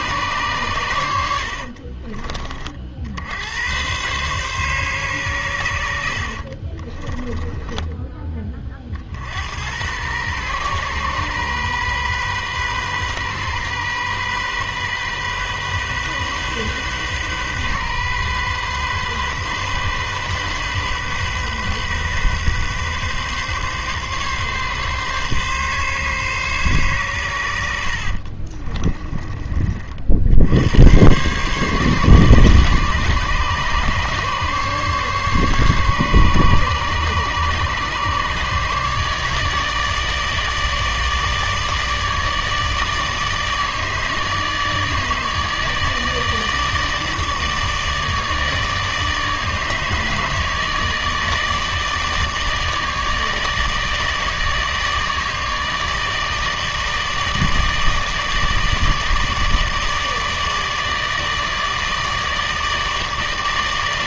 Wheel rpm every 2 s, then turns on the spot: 110, 40, 130, 50, 40, 130, 130, 130, 130, 130, 130, 130, 140, 130, 40, 90, 140, 140, 140, 150, 150, 150, 160, 150, 160, 150, 160, 150, 160, 150, 150, 160.
6-8 28-30